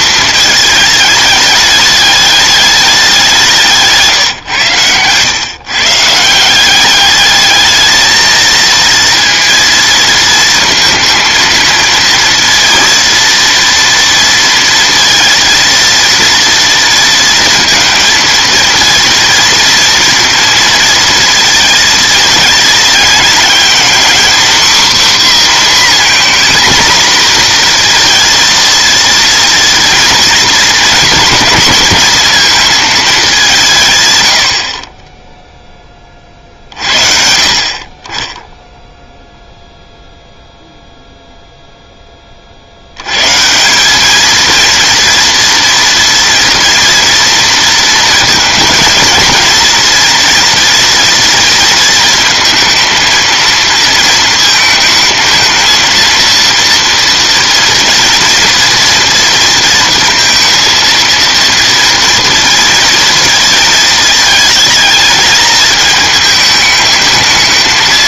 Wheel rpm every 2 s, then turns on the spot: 220, 200, 120, 180, 230, 230, 230, 230, 230, 230, 230, 220, 260, 250, 230, 230, 230, 60, 50, 0, 0, 60, 230, 230, 220, 230, 220, 220, 230, 230, 230, 230, 220, 220.
none